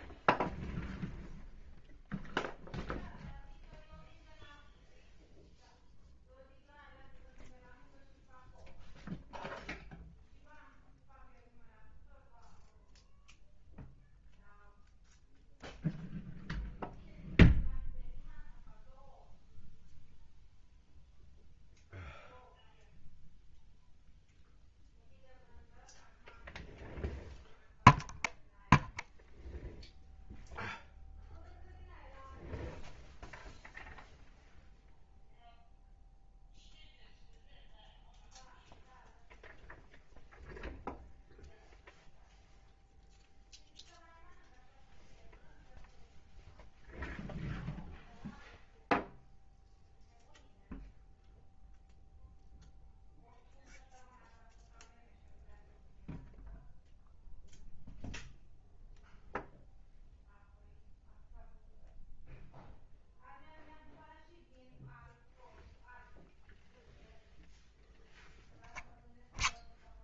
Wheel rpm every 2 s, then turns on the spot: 0, 0, 0, 0, 0, 0, 0, 0, 0, 0, 0, 0, 0, 0, 0, 0, 0, 0, 0, 0, 0, 0, 0, 0, 0, 0, 0, 0, 0, 0, 0, 0, 0, 0, 0.
none